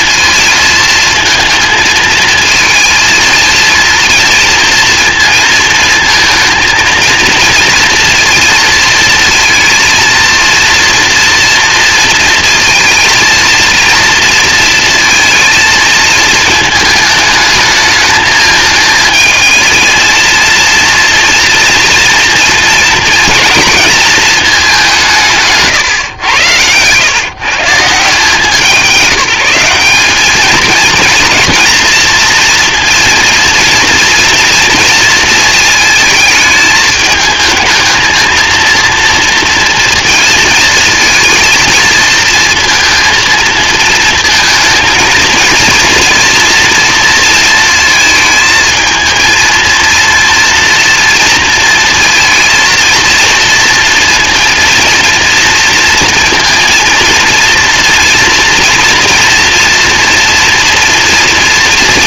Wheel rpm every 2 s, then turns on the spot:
220, 230, 230, 230, 230, 230, 230, 230, 220, 220, 230, 230, 190, 120, 170, 220, 230, 230, 220, 230, 220, 230, 230, 240, 220, 230, 230, 230, 230, 230, 240.
none